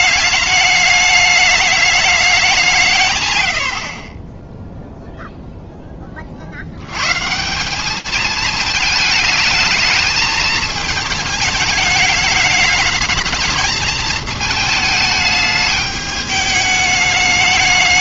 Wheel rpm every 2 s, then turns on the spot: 210, 200, 0, 80, 220, 220, 210, 210, 210.
none